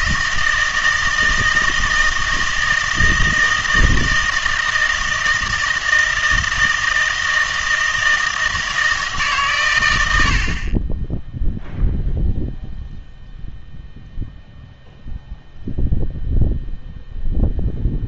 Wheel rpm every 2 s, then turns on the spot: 160, 160, 160, 160, 160, 30, 0, 0, 0.
none